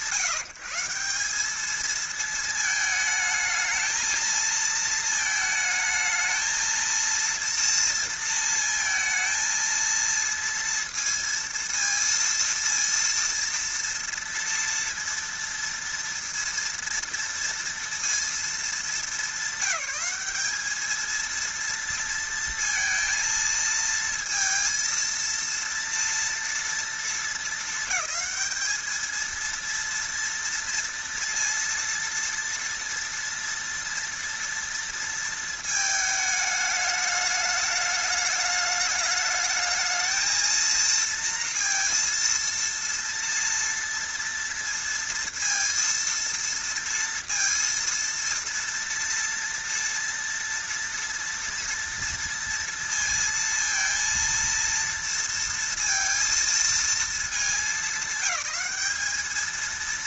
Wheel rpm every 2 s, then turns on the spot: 170, 220, 220, 230, 220, 230, 230, 230, 230, 200, 220, 230, 230, 230, 220, 230, 230, 230, 210, 210, 230, 230, 230, 230, 230, 230, 230, 230, 230, 210.
none